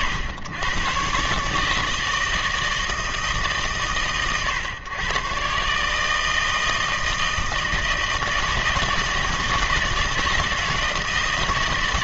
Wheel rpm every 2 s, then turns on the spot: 110, 160, 110, 160, 160, 160.
none